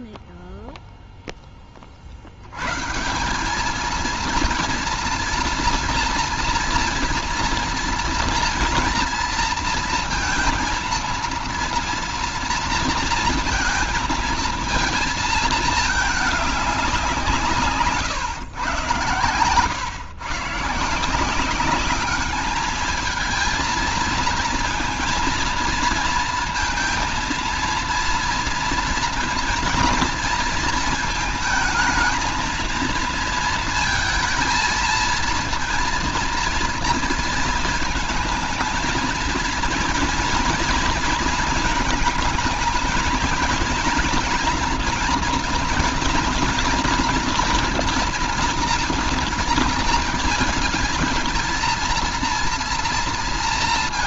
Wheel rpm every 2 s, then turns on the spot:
0, 100, 230, 230, 230, 230, 230, 230, 210, 110, 130, 210, 230, 230, 230, 230, 220, 230, 230, 230, 230, 230, 240, 230, 230, 230, 230.
none